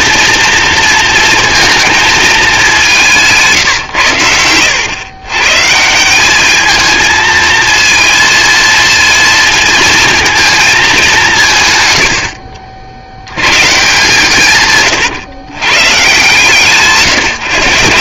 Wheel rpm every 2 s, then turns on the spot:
230, 190, 110, 220, 230, 200, 70, 130, 150.
14-16